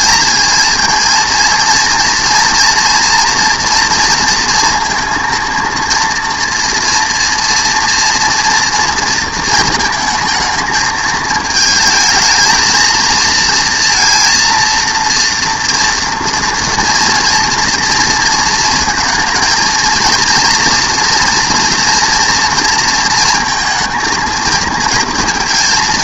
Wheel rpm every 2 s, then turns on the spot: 220, 240, 230, 230, 230, 220, 220, 230, 230, 230, 230, 230, 230.
none